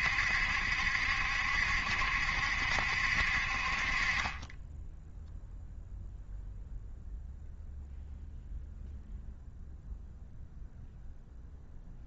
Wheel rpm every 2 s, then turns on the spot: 70, 70, 10, 0, 0, 0.
none